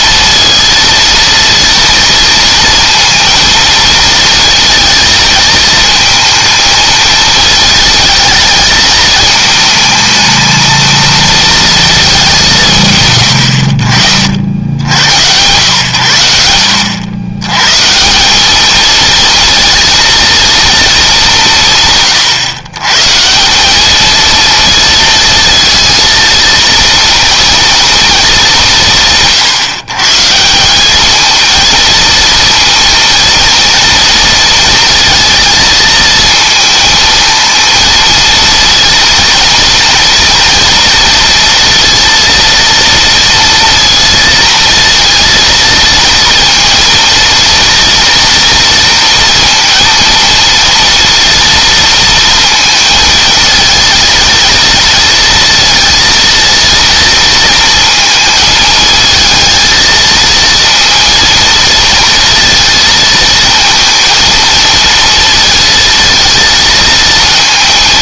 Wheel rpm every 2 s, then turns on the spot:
230, 230, 220, 220, 220, 230, 150, 90, 80, 220, 220, 130, 230, 230, 170, 190, 230, 230, 230, 230, 230, 230, 230, 230, 230, 230, 230, 230, 230, 220, 230, 230, 230, 230.
none